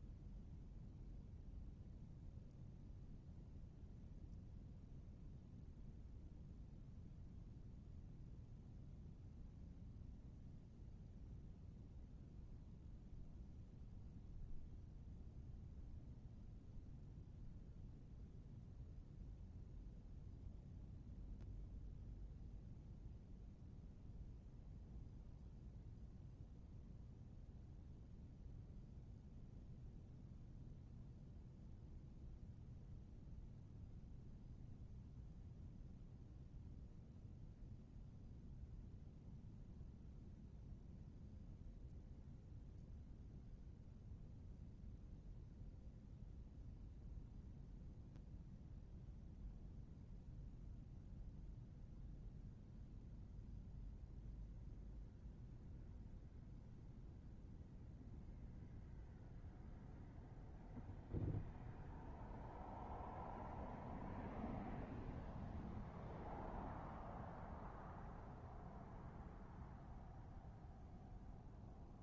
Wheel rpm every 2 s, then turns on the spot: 0, 0, 0, 0, 0, 0, 0, 0, 0, 0, 0, 0, 0, 0, 0, 0, 0, 0, 0, 0, 0, 0, 0, 0, 0, 0, 0, 0, 0, 0, 0, 0, 0, 0, 0, 0.
none